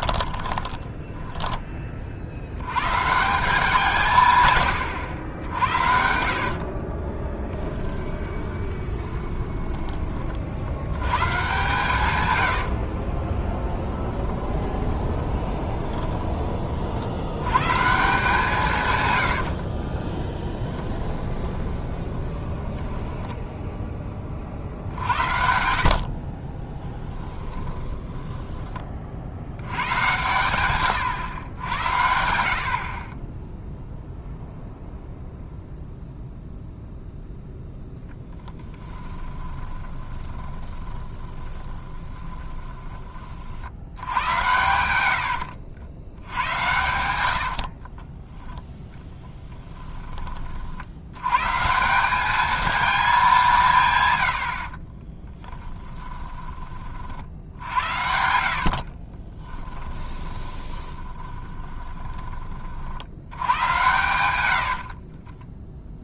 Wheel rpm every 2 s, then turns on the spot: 20, 100, 110, 50, 20, 70, 60, 20, 40, 140, 20, 10, 50, 20, 20, 120, 50, 0, 0, 10, 20, 20, 100, 90, 0, 50, 220, 50, 40, 50, 20, 50, 80.
0-2 6-10 12-16 20-24 26-28 38-42 44-46 54-56 58-62 64-66